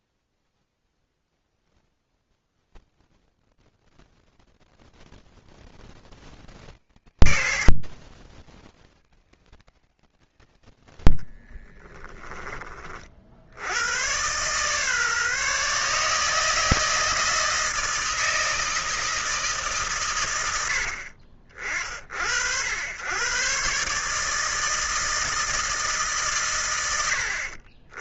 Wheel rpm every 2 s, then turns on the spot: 10, 20, 20, 80, 80, 90, 30, 140, 160, 160, 100, 80, 160, 120.
0-6 10-12